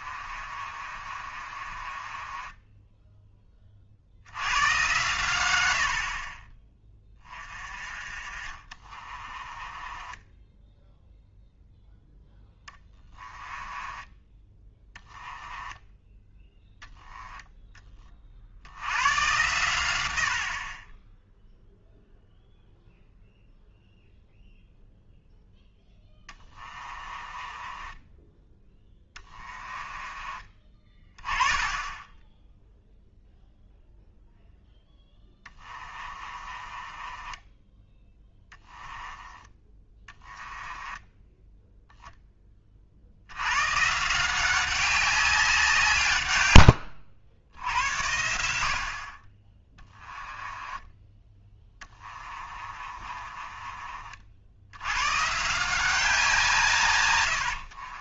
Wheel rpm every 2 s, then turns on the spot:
40, 10, 100, 20, 30, 10, 10, 10, 10, 90, 40, 0, 0, 20, 10, 20, 0, 0, 30, 10, 10, 30, 190, 100, 70, 10, 30, 80, 140.
0-4 8-14 26-28 36-42 46-48 50-54